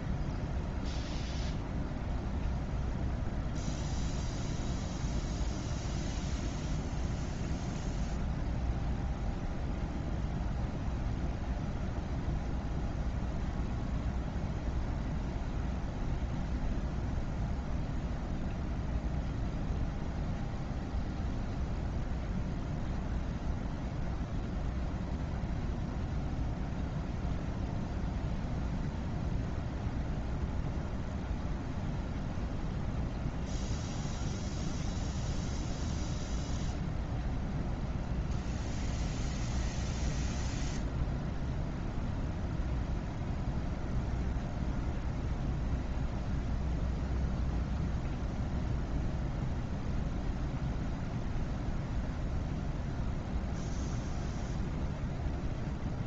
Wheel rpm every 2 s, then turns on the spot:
0, 0, 0, 0, 0, 0, 0, 0, 0, 0, 0, 0, 0, 0, 0, 0, 0, 0, 0, 0, 0, 0, 0, 0, 0, 0, 0, 0.
none